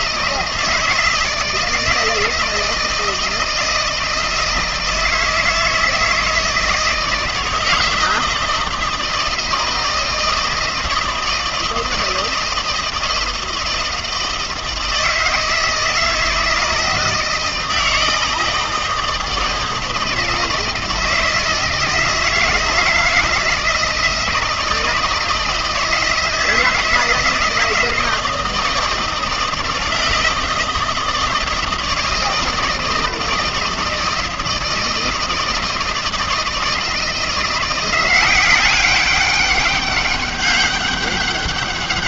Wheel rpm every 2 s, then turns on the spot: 160, 160, 160, 160, 160, 160, 160, 160, 160, 160, 160, 160, 160, 160, 160, 160, 160, 160, 160, 190, 200.
none